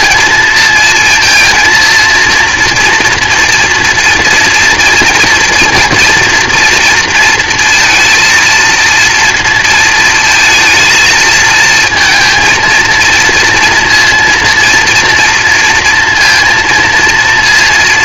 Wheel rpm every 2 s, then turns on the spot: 220, 230, 240, 230, 230, 220, 230, 230, 230.
none